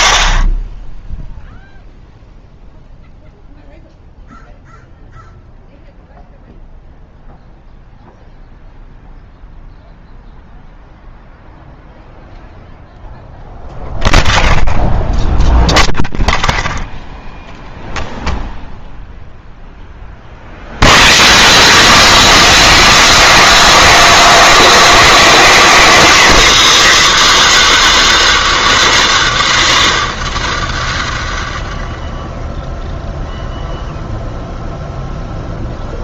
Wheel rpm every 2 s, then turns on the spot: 0, 0, 0, 0, 0, 0, 0, 0, 0, 0, 0, 40, 250, 130, 140, 110, 190, 50.
26-28